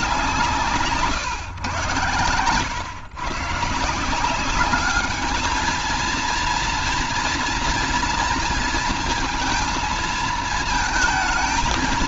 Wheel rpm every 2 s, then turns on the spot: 150, 130, 210, 230, 230, 220.
none